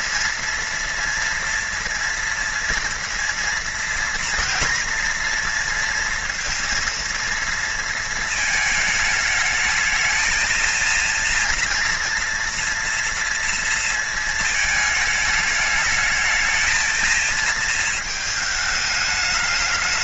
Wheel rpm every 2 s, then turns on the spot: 230, 230, 240, 230, 220, 230, 230, 220, 220, 220.
none